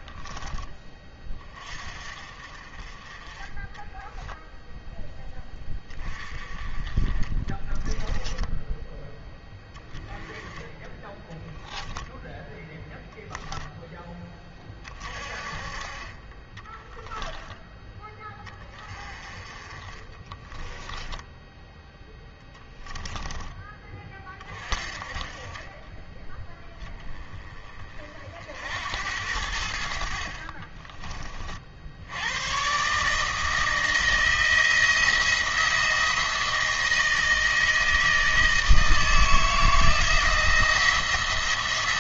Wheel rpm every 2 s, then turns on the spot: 20, 40, 0, 30, 10, 10, 10, 30, 20, 20, 10, 10, 40, 10, 70, 30, 130, 170, 160, 160, 170.
16-18 20-22 30-32